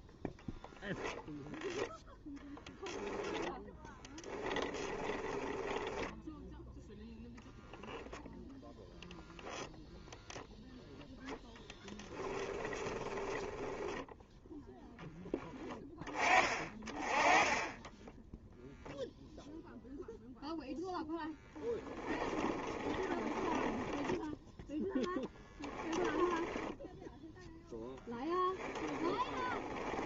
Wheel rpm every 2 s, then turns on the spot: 10, 0, 10, 0, 0, 0, 20, 0, 30, 0, 0, 20, 10, 10, 10.
0-2 4-6 12-14 22-26 28-30